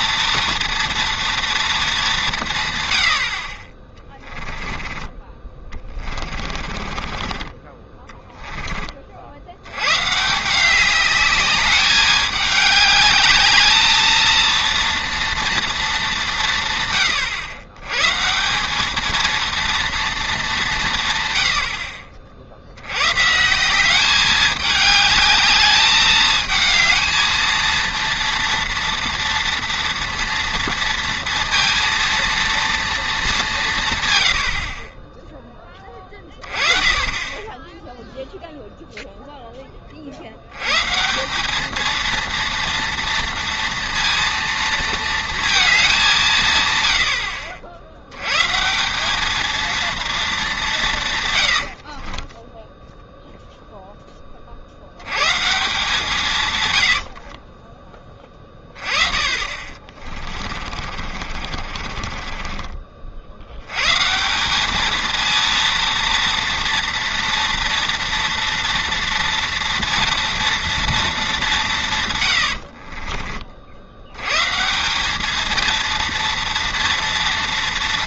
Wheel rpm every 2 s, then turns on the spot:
230, 150, 10, 40, 20, 170, 210, 230, 150, 180, 190, 80, 210, 220, 230, 230, 230, 60, 30, 0, 110, 230, 230, 130, 160, 200, 10, 50, 120, 20, 30, 30, 200, 230, 230, 230, 80, 150, 230.
4-8 52-54 60-64 72-74